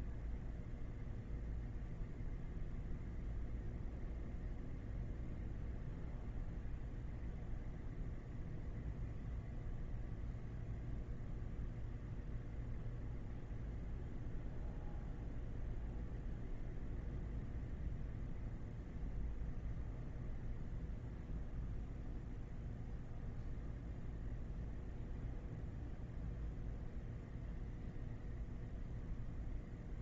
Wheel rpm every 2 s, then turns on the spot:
0, 0, 0, 0, 0, 0, 0, 0, 0, 0, 0, 0, 0, 0, 0.
none